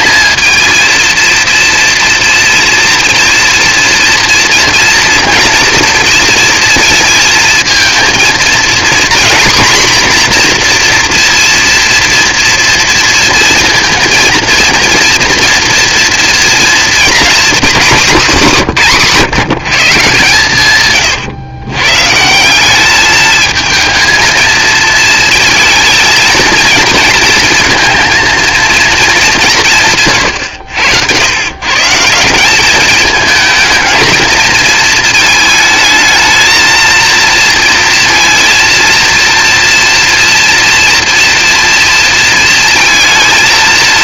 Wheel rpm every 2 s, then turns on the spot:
230, 230, 230, 230, 230, 240, 240, 230, 240, 200, 130, 200, 220, 230, 230, 100, 200, 220, 220, 230, 230, 230.
none